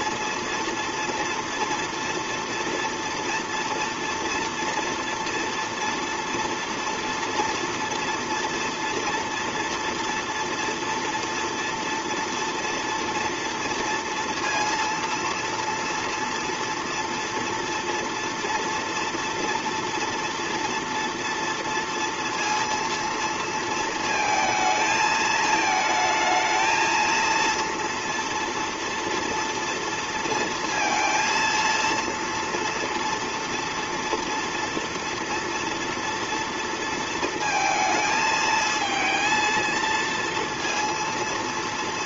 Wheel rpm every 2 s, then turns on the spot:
230, 230, 230, 230, 230, 230, 230, 230, 230, 230, 230, 230, 220, 230, 230, 230, 230, 230, 230, 220, 230.
none